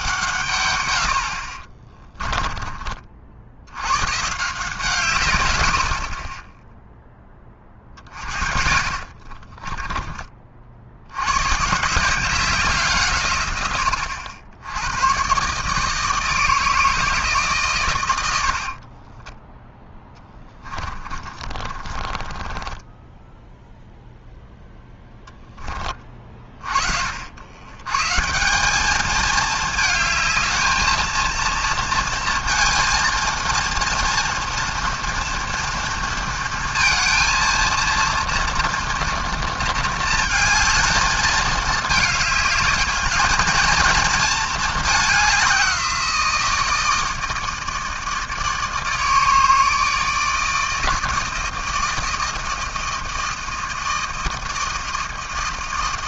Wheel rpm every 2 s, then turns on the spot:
50, 60, 120, 10, 40, 110, 140, 130, 150, 20, 30, 0, 10, 70, 220, 230, 230, 230, 230, 230, 220, 220, 200, 160, 160, 160, 160, 160.
8-10 18-22